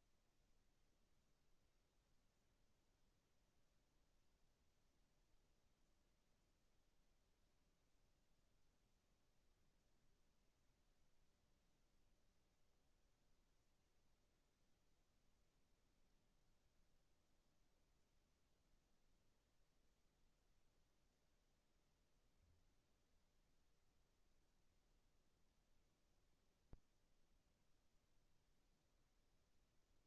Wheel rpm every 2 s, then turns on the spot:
0, 0, 0, 0, 0, 0, 0, 0, 0, 0, 0, 0, 0, 0, 0.
none